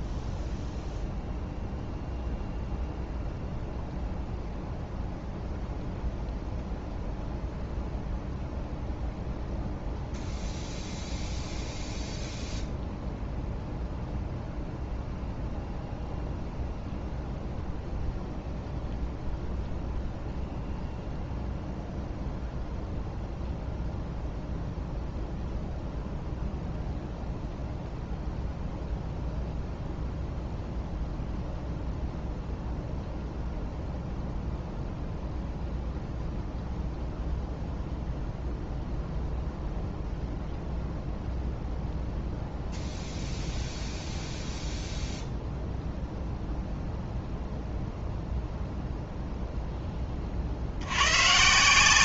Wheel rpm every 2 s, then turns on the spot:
0, 0, 0, 0, 0, 0, 0, 0, 0, 0, 0, 0, 0, 0, 0, 0, 0, 0, 0, 0, 0, 0, 0, 0, 0, 60.
none